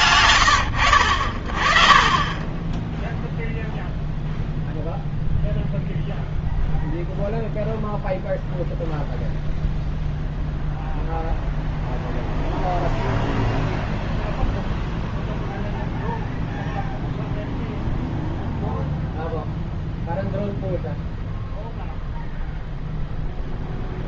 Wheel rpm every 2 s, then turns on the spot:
40, 0, 0, 0, 0, 0, 0, 0, 0, 0, 0, 0.
none